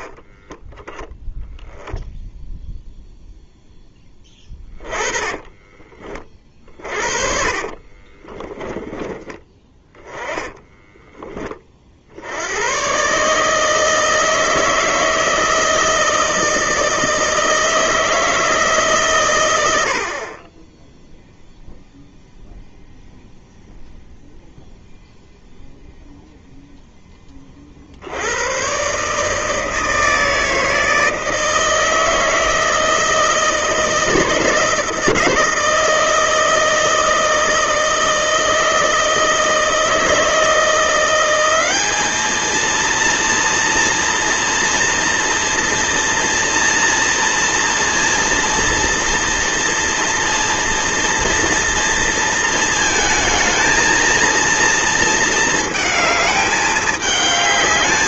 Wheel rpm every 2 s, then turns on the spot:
30, 0, 20, 30, 10, 10, 100, 160, 160, 150, 20, 0, 0, 0, 110, 160, 160, 160, 160, 160, 170, 220, 230, 230, 230, 230, 230, 230, 210.
4-8 10-12